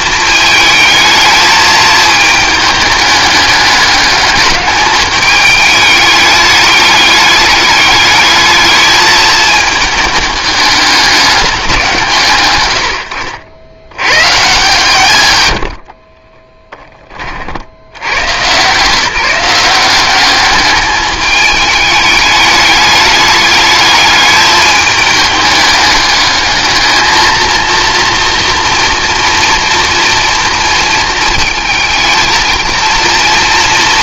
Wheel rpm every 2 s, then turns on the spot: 220, 220, 210, 210, 220, 210, 90, 150, 10, 150, 210, 210, 210, 220, 230, 230, 230.
none